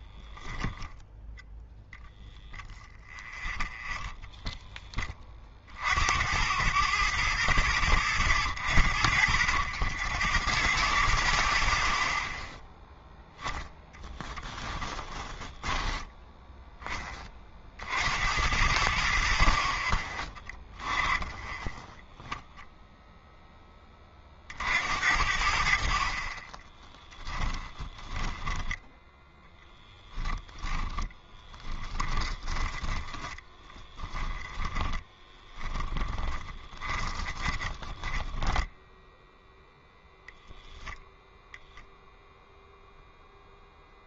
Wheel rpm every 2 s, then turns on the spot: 0, 0, 10, 80, 60, 70, 0, 10, 10, 60, 10, 0, 60, 20, 10, 20, 10, 20, 30, 0, 0, 0.
14-16 26-28 30-38